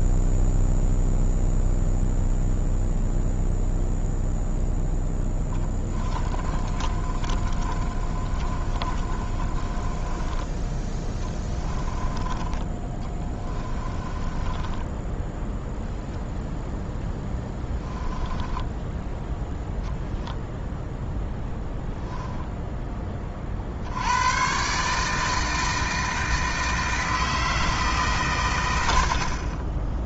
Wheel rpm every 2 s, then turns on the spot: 0, 0, 0, 30, 30, 10, 20, 20, 0, 10, 10, 10, 140, 160, 90.
6-10 12-16